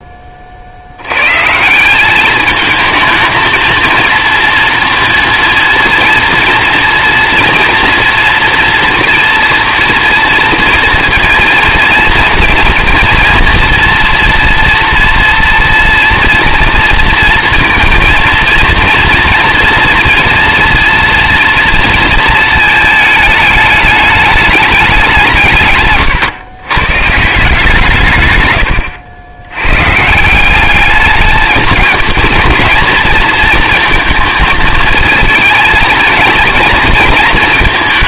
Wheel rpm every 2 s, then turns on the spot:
100, 220, 230, 230, 230, 230, 230, 240, 230, 230, 230, 220, 190, 140, 90, 210, 220, 220, 230.
none